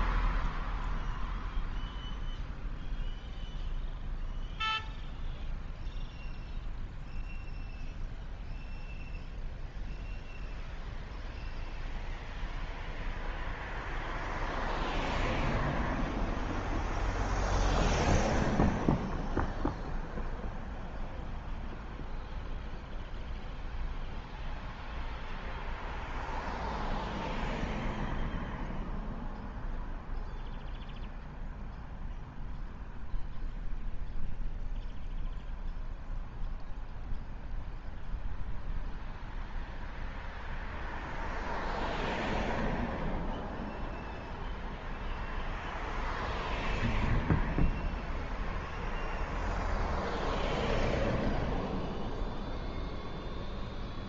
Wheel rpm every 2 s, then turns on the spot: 0, 0, 0, 0, 0, 0, 0, 0, 0, 0, 0, 0, 0, 0, 0, 0, 0, 0, 0, 0, 0, 0, 0, 0, 0, 0, 0.
none